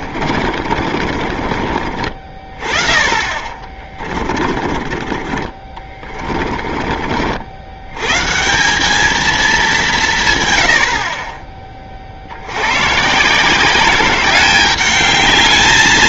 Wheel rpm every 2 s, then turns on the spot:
40, 30, 40, 40, 180, 110, 100, 190.
0-2 4-6